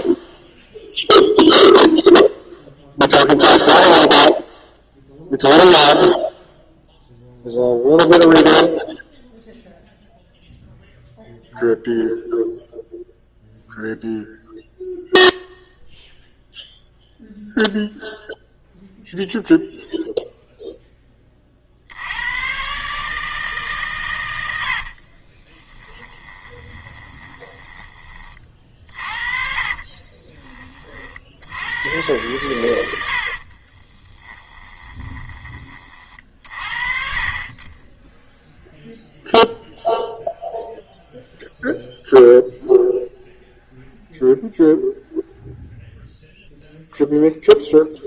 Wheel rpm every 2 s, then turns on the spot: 0, 0, 0, 0, 0, 0, 0, 0, 0, 0, 0, 130, 90, 20, 40, 30, 110, 20, 40, 0, 0, 0, 0, 0.
24-30 34-36